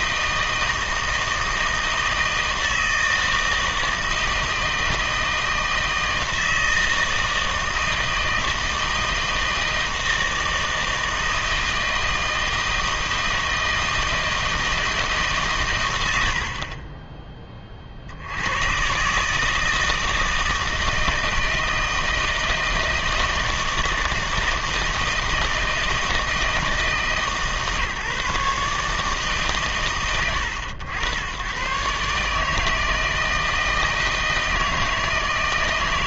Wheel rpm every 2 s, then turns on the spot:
160, 160, 160, 160, 160, 160, 160, 160, 40, 110, 160, 160, 160, 160, 150, 100, 160, 160.
none